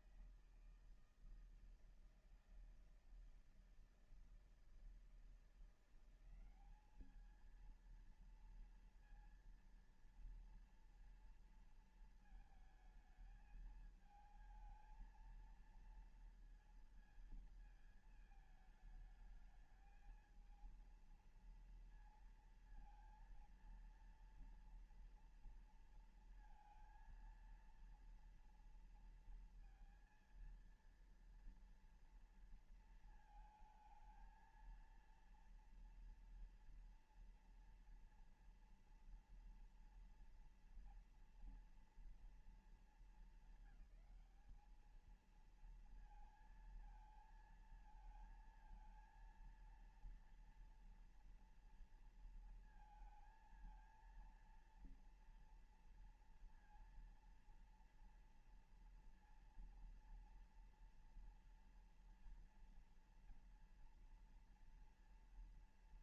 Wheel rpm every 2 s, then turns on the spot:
160, 160, 160, 190, 230, 230, 220, 220, 230, 220, 220, 230, 230, 230, 230, 230, 230, 220, 230, 230, 230, 220, 200, 220, 220, 230, 230, 230, 230, 230, 230, 230, 230.
none